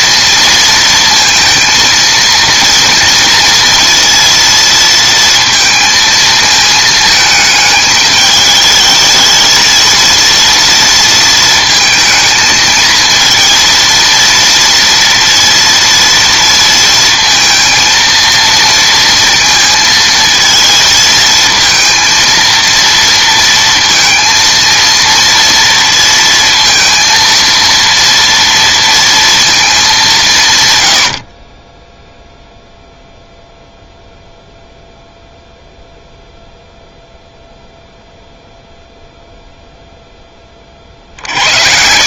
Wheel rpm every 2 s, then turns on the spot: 230, 230, 230, 220, 210, 230, 230, 230, 230, 230, 220, 230, 230, 230, 230, 120, 0, 0, 0, 0, 30.
none